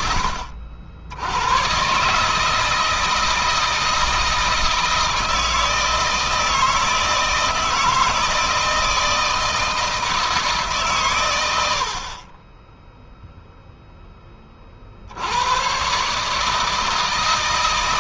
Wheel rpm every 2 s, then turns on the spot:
60, 160, 160, 160, 170, 140, 10, 60, 160.
none